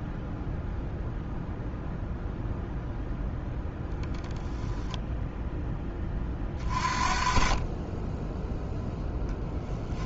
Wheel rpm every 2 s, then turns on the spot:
0, 0, 10, 30, 0.
4-6